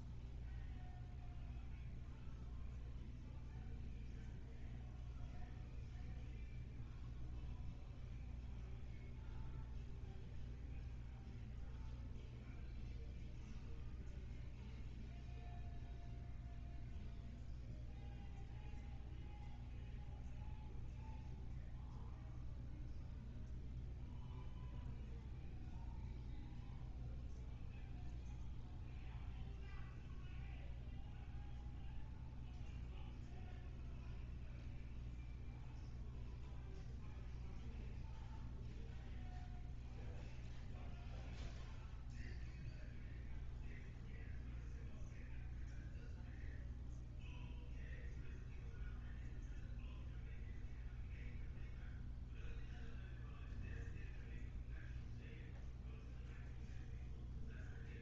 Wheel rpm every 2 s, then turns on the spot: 0, 0, 0, 0, 0, 0, 0, 0, 0, 0, 0, 0, 0, 0, 0, 0, 0, 0, 0, 0, 0, 0, 0, 0, 0, 0, 0, 0, 0.
none